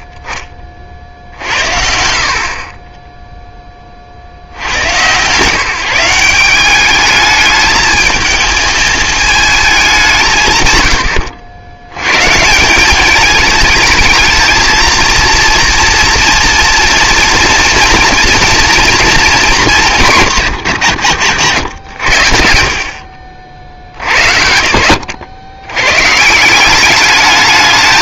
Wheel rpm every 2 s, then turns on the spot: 50, 40, 80, 200, 220, 130, 180, 220, 230, 230, 100, 70, 80, 190.
none